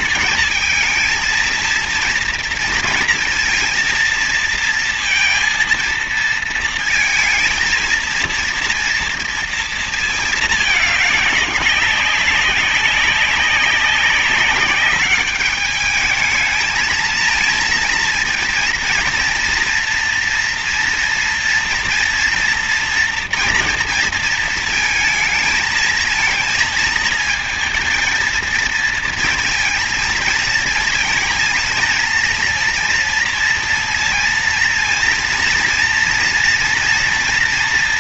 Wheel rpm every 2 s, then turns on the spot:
220, 230, 230, 230, 230, 210, 200, 200, 220, 230, 240, 230, 230, 220, 230, 230, 230, 230, 230.
none